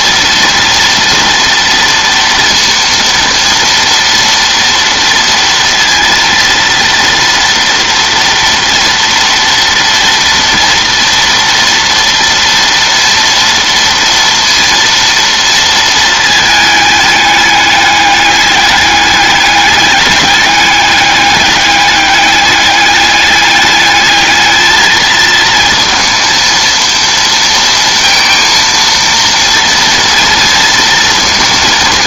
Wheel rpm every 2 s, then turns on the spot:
230, 230, 230, 230, 230, 230, 230, 230, 210, 210, 210, 210, 220, 230, 230, 230.
none